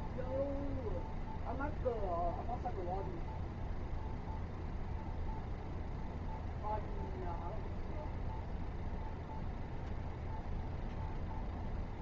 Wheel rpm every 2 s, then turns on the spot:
0, 0, 0, 0, 0, 0.
none